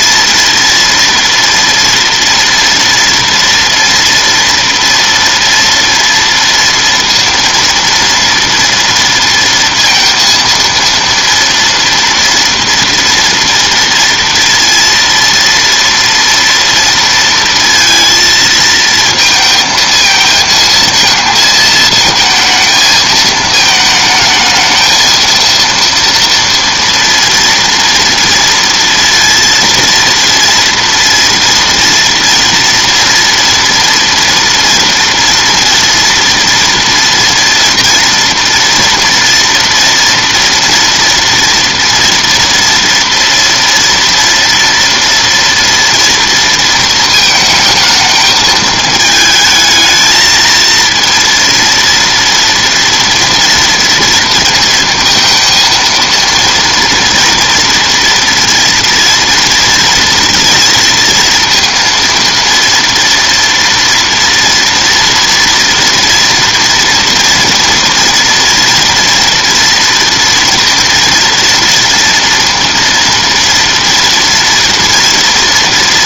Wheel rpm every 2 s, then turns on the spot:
230, 230, 230, 230, 230, 230, 230, 230, 230, 230, 230, 220, 220, 230, 230, 230, 230, 230, 230, 230, 230, 230, 230, 230, 220, 230, 230, 230, 230, 230, 230, 230, 230, 240, 240, 230, 230, 230.
none